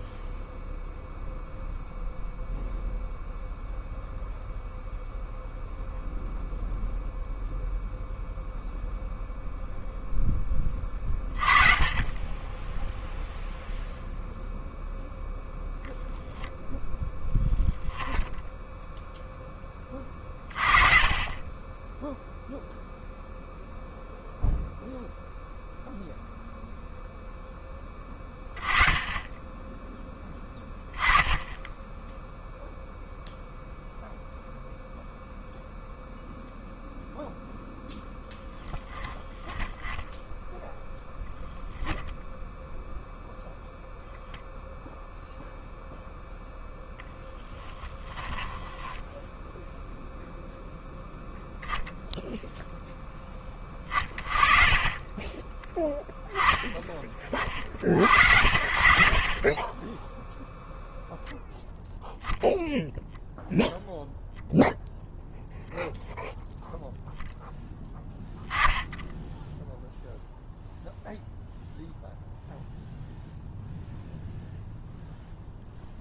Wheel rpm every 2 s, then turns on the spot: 0, 0, 0, 0, 0, 10, 10, 0, 0, 10, 40, 0, 0, 0, 20, 20, 0, 0, 0, 0, 0, 0, 0, 0, 10, 0, 0, 30, 10, 70, 0, 0, 0, 0, 10, 0, 0, 0.
18-20 48-50